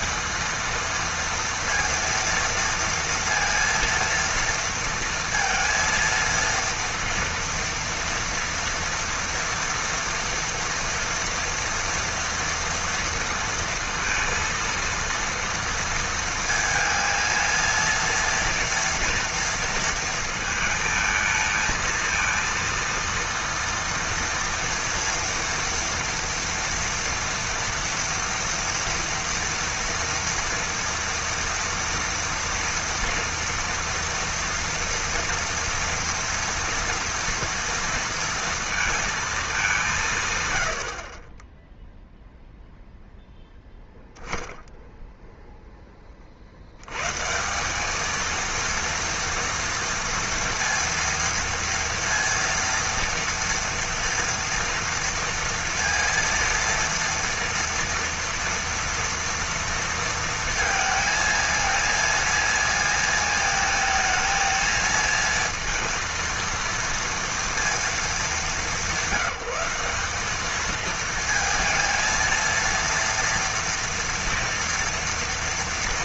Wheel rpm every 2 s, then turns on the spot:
230, 230, 230, 230, 230, 230, 230, 230, 230, 230, 220, 230, 230, 230, 230, 230, 240, 230, 230, 230, 90, 0, 10, 80, 230, 230, 230, 230, 230, 230, 230, 230, 220, 230, 190, 220, 230, 230.
none